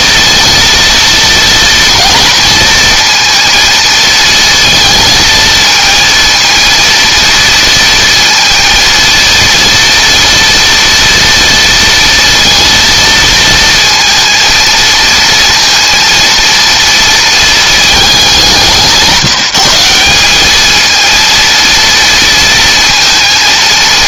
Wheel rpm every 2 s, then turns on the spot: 230, 230, 230, 230, 230, 230, 230, 230, 230, 180, 220, 230.
none